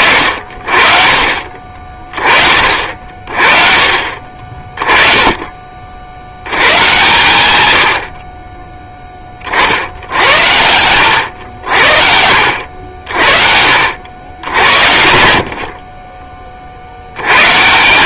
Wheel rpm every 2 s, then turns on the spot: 50, 50, 30, 130, 10, 80, 80, 70, 50.
none